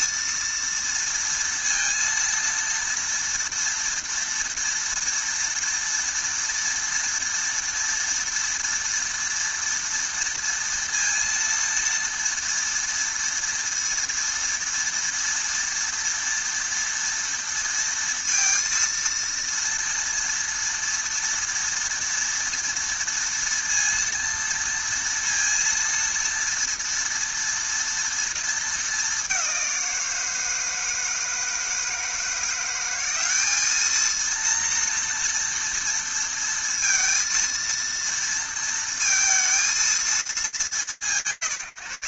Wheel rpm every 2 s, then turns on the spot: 230, 230, 230, 230, 230, 230, 230, 230, 230, 230, 230, 230, 230, 230, 210, 160, 190, 240, 230, 230, 160.
none